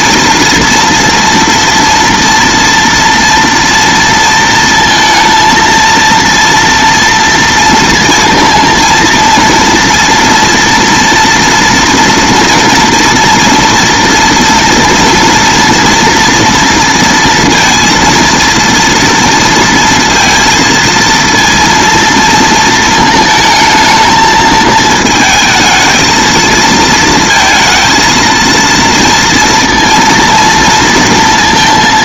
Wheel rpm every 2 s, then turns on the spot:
230, 230, 230, 230, 230, 230, 240, 230, 230, 230, 230, 230, 220, 220, 230, 230.
none